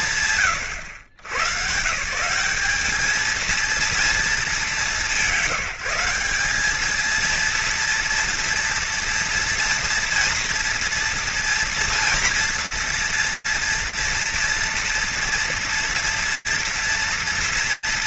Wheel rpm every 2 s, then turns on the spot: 120, 230, 160, 230, 230, 230, 240, 230, 230.
none